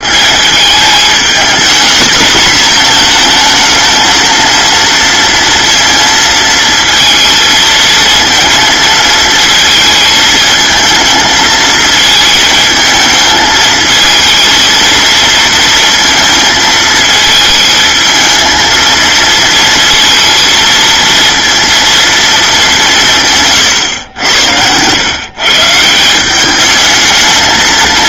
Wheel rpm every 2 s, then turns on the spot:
210, 230, 230, 230, 230, 220, 220, 230, 230, 230, 230, 210, 100, 210.
none